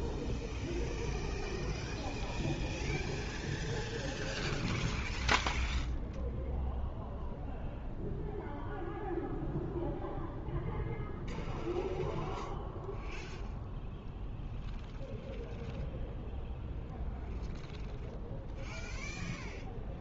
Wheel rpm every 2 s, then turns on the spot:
0, 0, 0, 0, 0, 0, 0, 0, 0, 0.
none